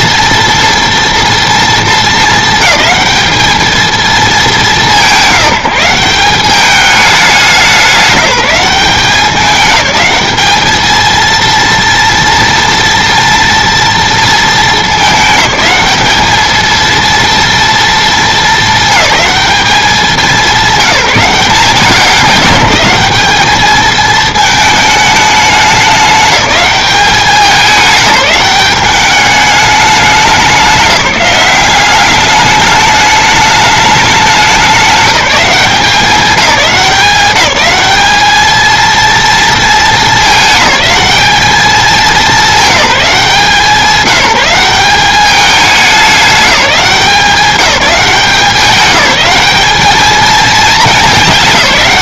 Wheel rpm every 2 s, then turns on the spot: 230, 220, 170, 200, 190, 220, 230, 220, 230, 220, 200, 190, 210, 200, 190, 180, 210, 190, 180, 230, 210, 190, 190, 190, 200, 220.
none